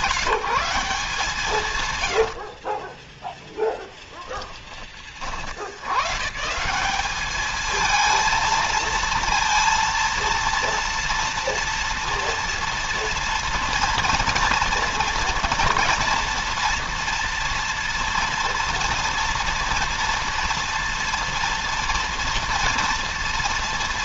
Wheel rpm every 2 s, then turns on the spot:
150, 10, 30, 190, 230, 230, 230, 230, 230, 230, 230, 230.
2-4